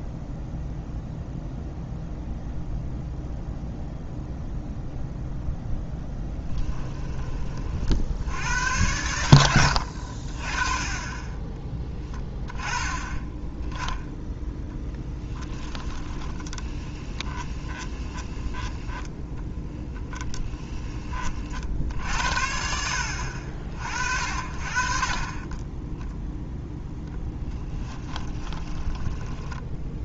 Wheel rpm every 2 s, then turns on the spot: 0, 0, 0, 10, 100, 20, 10, 10, 10, 0, 10, 70, 40, 0, 10.
6-8 14-18 28-30